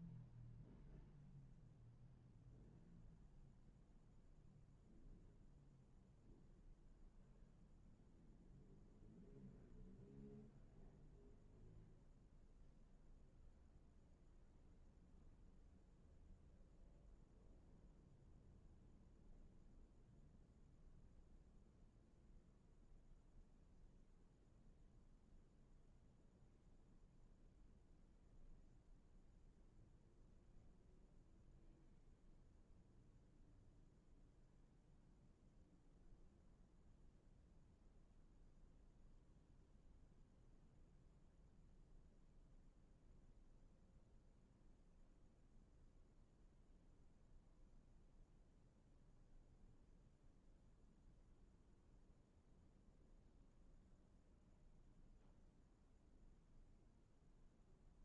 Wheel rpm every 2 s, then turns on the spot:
0, 0, 0, 0, 0, 0, 0, 0, 0, 0, 0, 0, 0, 0, 0, 0, 0, 0, 0, 0, 0, 0, 0, 0, 0, 0, 0, 0, 0.
none